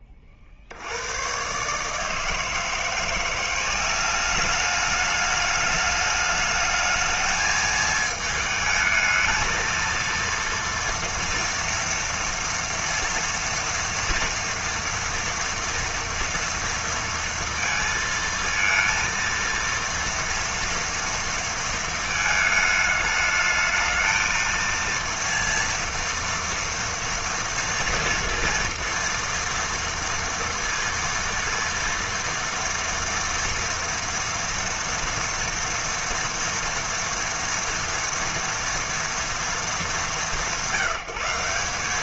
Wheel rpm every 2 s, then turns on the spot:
90, 170, 210, 220, 220, 230, 230, 230, 230, 230, 230, 220, 230, 230, 230, 230, 230, 230, 230, 230, 180.
none